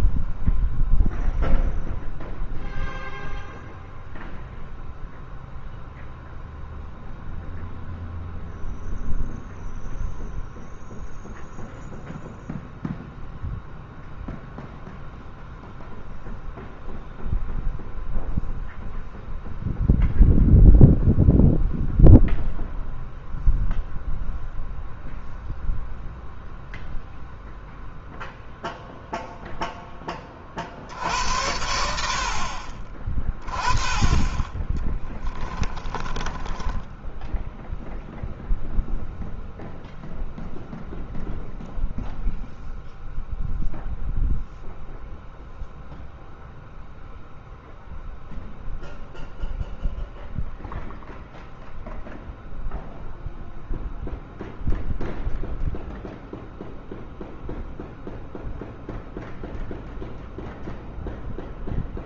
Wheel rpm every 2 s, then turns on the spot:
0, 0, 0, 0, 0, 0, 0, 0, 0, 0, 0, 0, 0, 0, 0, 70, 30, 10, 10, 0, 0, 0, 0, 0, 0, 0, 0, 0, 0, 0, 0.
34-38